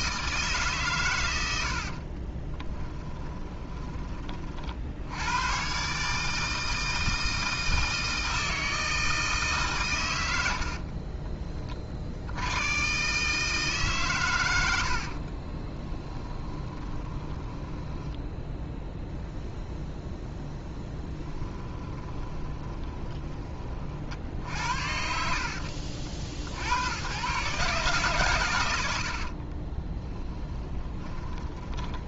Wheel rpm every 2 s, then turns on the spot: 140, 20, 40, 160, 160, 60, 120, 80, 20, 0, 10, 20, 60, 90, 100, 10.
2-4 10-12 16-18 22-24 30-32